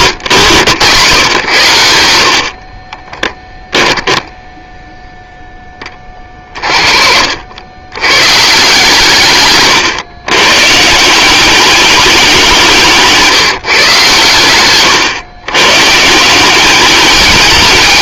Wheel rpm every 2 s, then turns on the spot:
130, 30, 0, 20, 130, 140, 180, 120, 190.
2-4